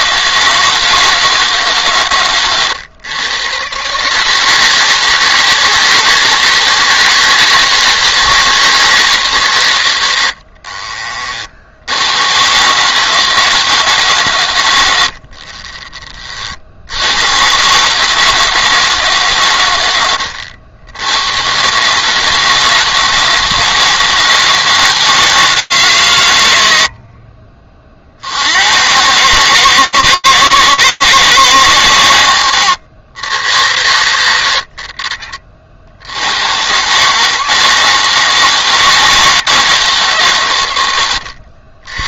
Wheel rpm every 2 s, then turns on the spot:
150, 130, 160, 160, 130, 60, 160, 50, 120, 120, 130, 160, 150, 40, 140, 150, 100, 60, 150, 160, 90.
14-16